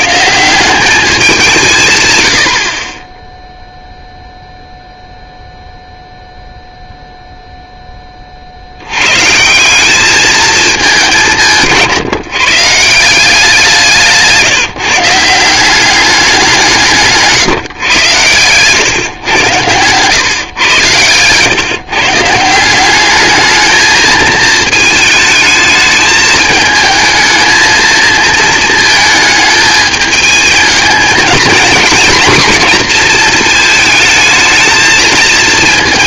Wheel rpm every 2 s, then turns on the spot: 160, 80, 0, 0, 50, 220, 150, 160, 190, 120, 120, 170, 220, 220, 220, 210, 230, 220.
none